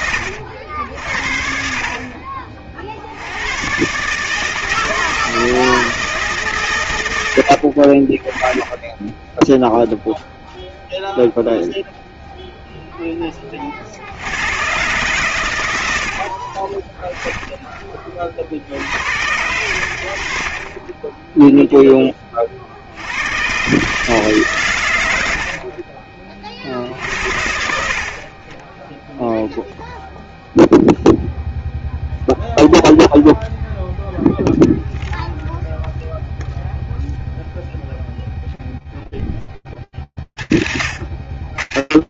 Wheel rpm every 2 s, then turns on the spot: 70, 50, 160, 120, 10, 0, 0, 120, 20, 80, 20, 70, 110, 60, 10, 0, 0, 0, 0, 0, 70.
8-10 16-18 20-22